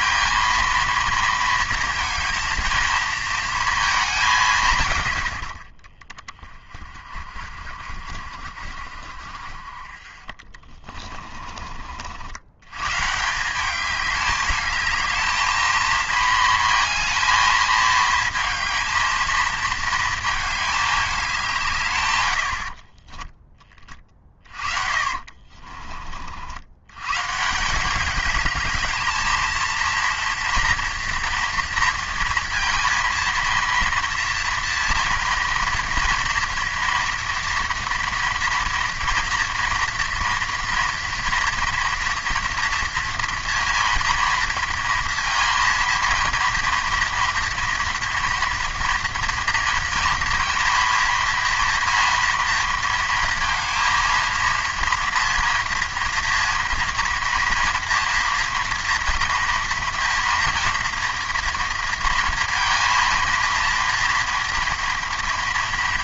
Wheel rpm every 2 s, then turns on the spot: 230, 230, 140, 30, 50, 30, 110, 210, 220, 220, 220, 60, 40, 90, 210, 240, 230, 230, 230, 230, 230, 230, 230, 230, 230, 230, 230, 230, 230, 230, 230, 230, 230.
10-12 22-26